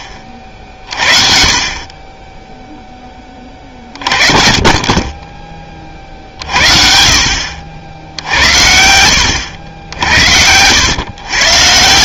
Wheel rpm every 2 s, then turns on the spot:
40, 10, 30, 60, 70, 90.
4-6